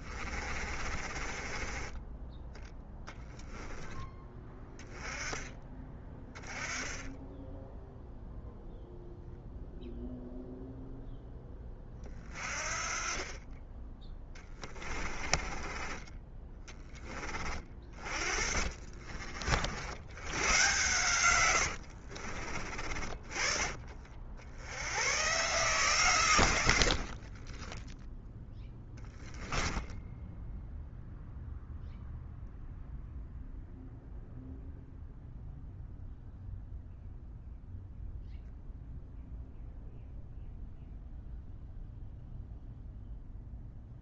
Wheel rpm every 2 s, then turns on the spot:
40, 10, 10, 10, 0, 0, 30, 20, 20, 50, 120, 40, 100, 80, 10, 0, 0, 0, 0, 0, 0, 0.
0-2 14-16 18-22 28-30